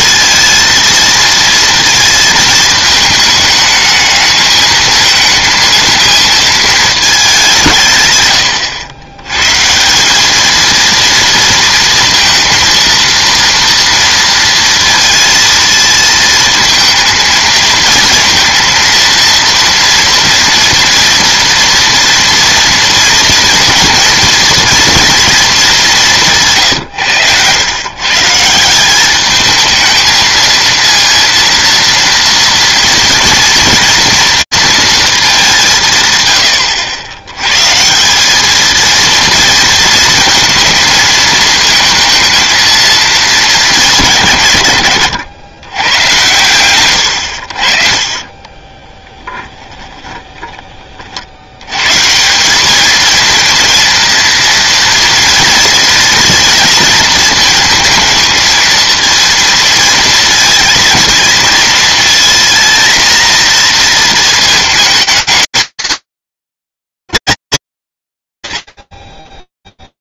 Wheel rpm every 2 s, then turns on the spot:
230, 220, 220, 220, 90, 220, 230, 230, 230, 230, 230, 230, 230, 150, 180, 230, 230, 230, 80, 220, 230, 220, 120, 110, 20, 40, 220, 240, 230, 220, 220, 230, 220, 230, 30.
26-28 48-50